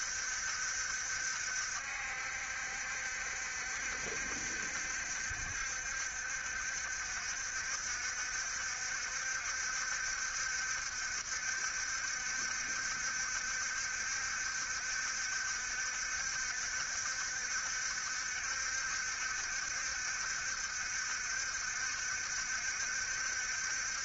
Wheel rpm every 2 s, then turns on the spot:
60, 70, 70, 60, 70, 70, 70, 70, 70, 70, 70, 70.
none